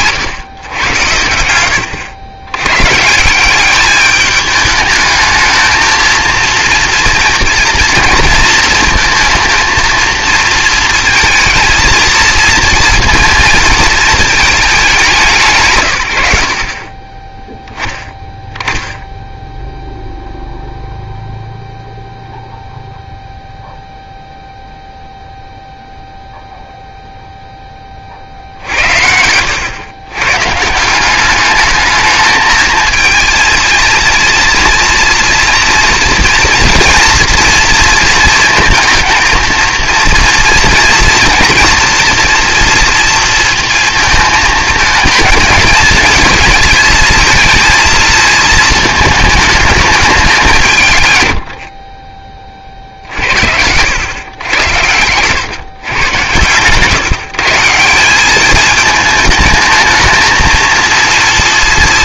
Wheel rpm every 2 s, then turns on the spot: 120, 110, 210, 230, 230, 230, 230, 210, 70, 10, 0, 0, 0, 0, 60, 140, 220, 230, 230, 230, 230, 230, 220, 220, 220, 170, 40, 100, 110, 210, 230.
none